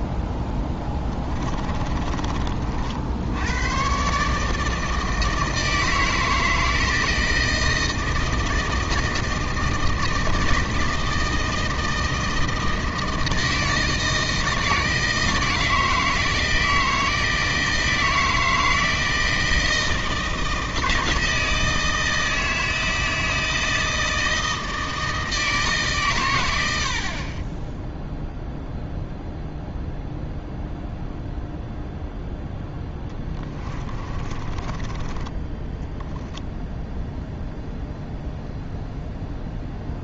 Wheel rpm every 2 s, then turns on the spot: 10, 50, 160, 160, 160, 160, 160, 160, 160, 160, 160, 160, 160, 60, 0, 0, 10, 20, 0, 0.
0-2 32-36